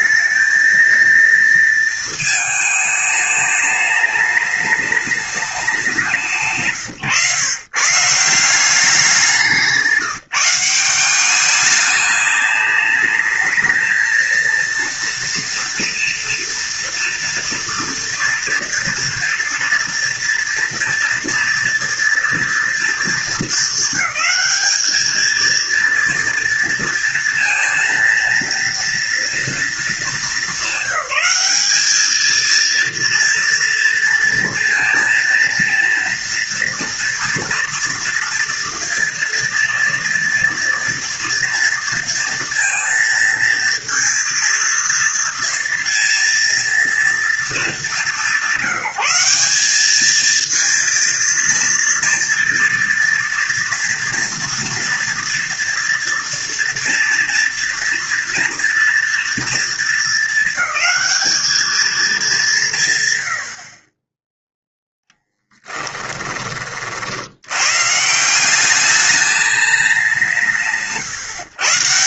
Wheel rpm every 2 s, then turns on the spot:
230, 210, 210, 150, 180, 180, 210, 230, 230, 230, 230, 220, 210, 230, 230, 200, 230, 230, 230, 230, 240, 230, 230, 230, 190, 230, 230, 240, 230, 230, 220, 130, 0, 60, 200, 150.
none